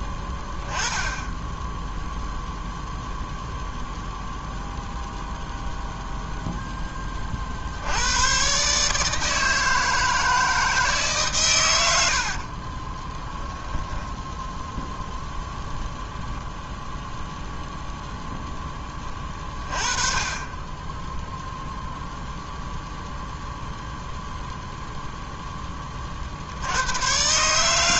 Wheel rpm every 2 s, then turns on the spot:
10, 0, 0, 0, 140, 160, 60, 10, 0, 10, 10, 0, 0, 70.
12-14